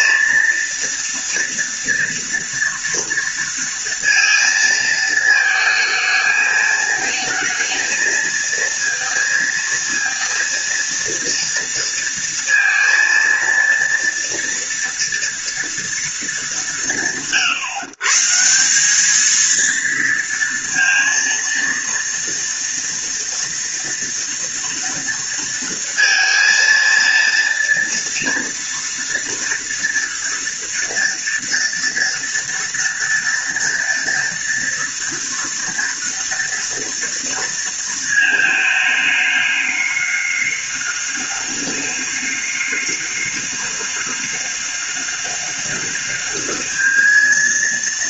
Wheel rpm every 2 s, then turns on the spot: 230, 230, 230, 220, 230, 230, 230, 230, 170, 170, 230, 230, 230, 230, 230, 230, 230, 230, 240, 220, 200, 200, 200, 210.
none